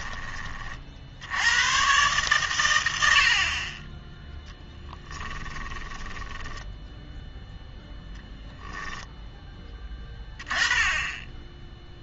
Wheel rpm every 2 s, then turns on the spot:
30, 110, 10, 10, 0, 20.
none